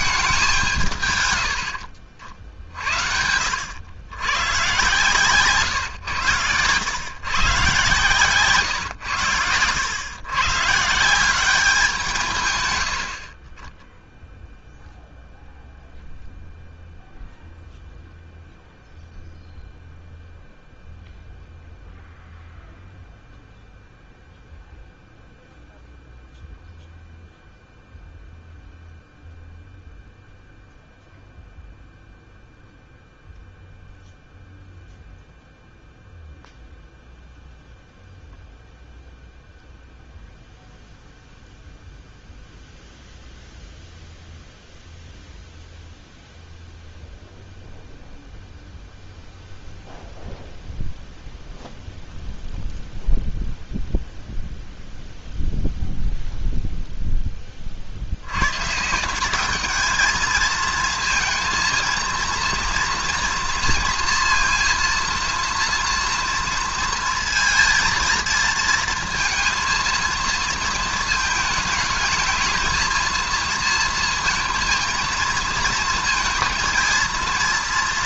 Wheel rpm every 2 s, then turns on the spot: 180, 60, 120, 110, 130, 140, 130, 0, 0, 0, 0, 0, 0, 0, 0, 0, 0, 0, 0, 0, 0, 0, 0, 0, 0, 0, 0, 0, 0, 130, 230, 230, 230, 230, 220, 220, 220, 230, 230.
none